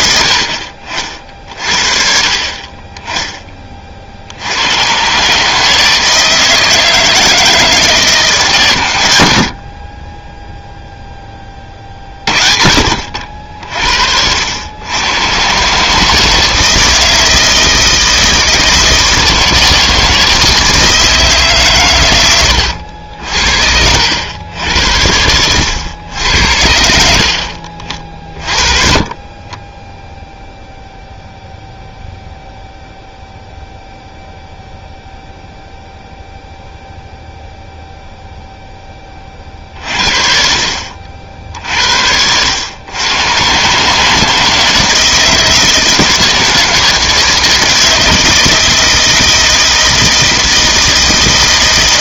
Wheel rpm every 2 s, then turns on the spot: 60, 30, 90, 160, 130, 0, 50, 90, 160, 160, 160, 90, 80, 70, 30, 0, 0, 0, 0, 10, 50, 90, 160, 160, 160, 160.
none